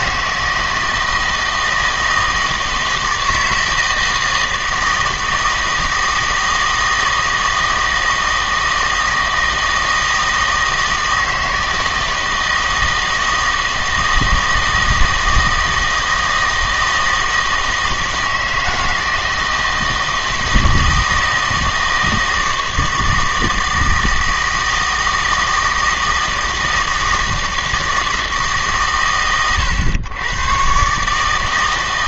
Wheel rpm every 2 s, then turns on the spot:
160, 160, 160, 160, 160, 160, 160, 160, 160, 160, 160, 160, 160, 160, 140, 130.
none